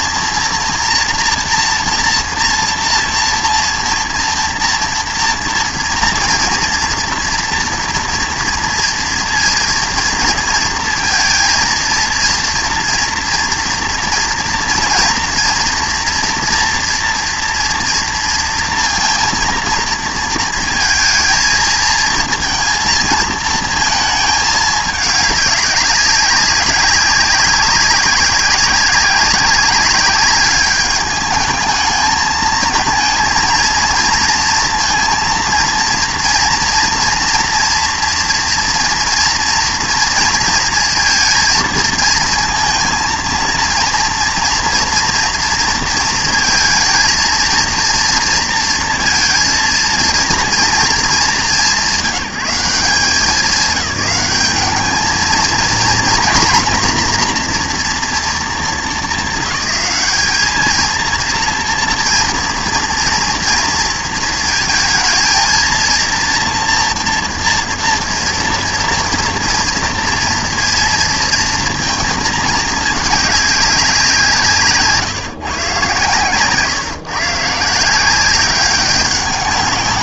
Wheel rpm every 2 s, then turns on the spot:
230, 230, 230, 230, 230, 230, 230, 230, 230, 230, 230, 220, 210, 190, 190, 200, 220, 230, 230, 230, 220, 230, 230, 220, 230, 230, 170, 210, 240, 230, 210, 230, 230, 230, 230, 230, 210, 170, 140, 190.
none